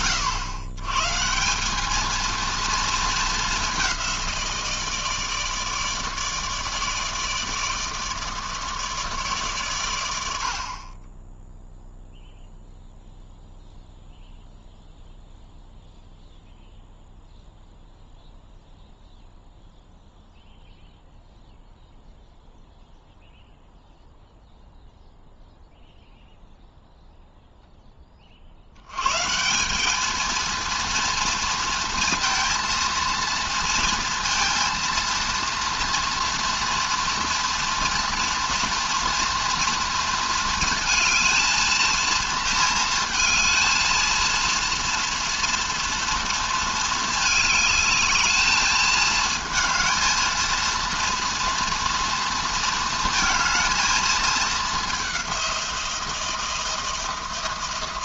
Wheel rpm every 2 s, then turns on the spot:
120, 220, 160, 150, 150, 30, 0, 0, 0, 0, 0, 0, 0, 0, 110, 230, 230, 230, 230, 230, 230, 220, 230, 220, 220, 230, 230, 200, 160.
none